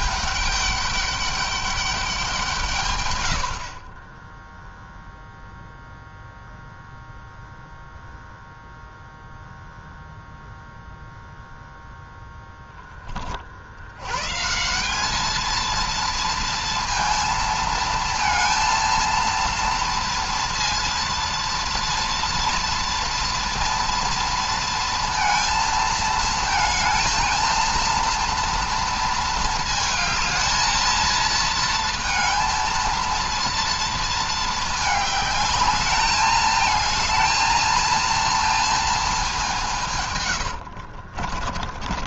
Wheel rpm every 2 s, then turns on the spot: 200, 140, 0, 0, 0, 0, 10, 190, 230, 230, 230, 230, 230, 230, 230, 230, 230, 220, 220, 220, 60.
40-42